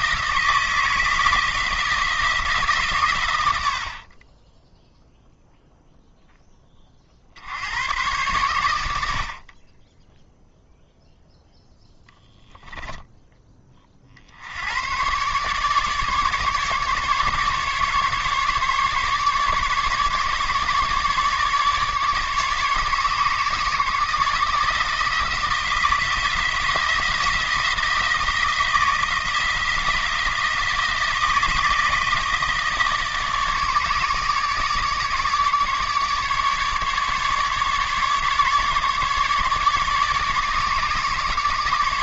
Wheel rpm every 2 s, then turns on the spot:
160, 140, 0, 20, 90, 0, 0, 110, 150, 150, 150, 150, 160, 160, 170, 160, 160, 150, 150, 150, 150.
none